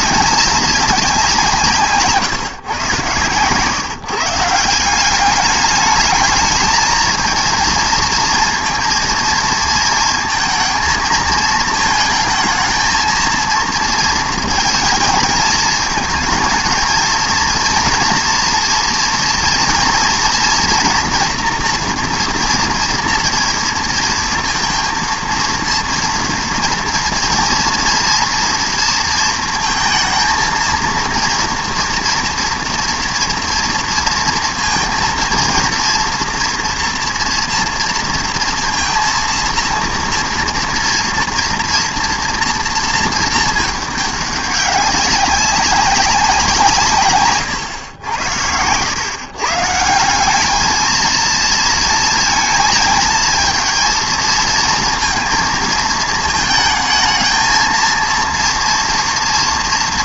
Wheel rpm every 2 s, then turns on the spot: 200, 140, 170, 220, 230, 230, 220, 220, 220, 230, 240, 230, 230, 230, 230, 230, 230, 230, 230, 230, 230, 230, 200, 170, 90, 210, 230, 230, 220, 230.
none